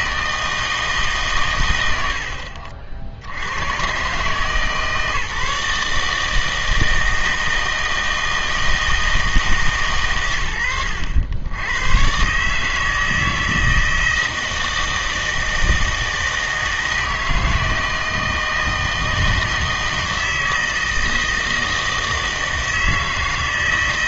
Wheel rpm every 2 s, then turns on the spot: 160, 60, 150, 160, 160, 100, 150, 160, 160, 160, 160, 160.
none